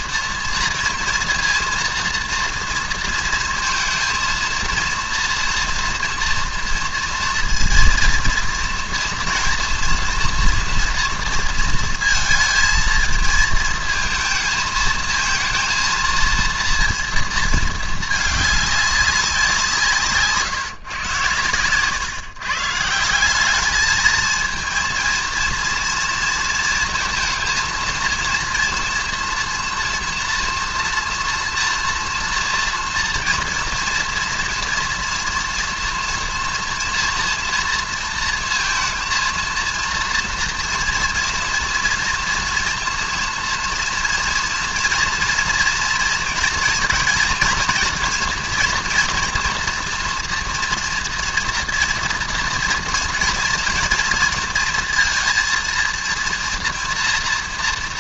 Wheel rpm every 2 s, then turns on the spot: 230, 230, 230, 230, 230, 240, 220, 220, 230, 200, 130, 150, 230, 230, 230, 240, 230, 230, 230, 230, 230, 230, 230, 230, 230, 230, 240, 230, 230.
none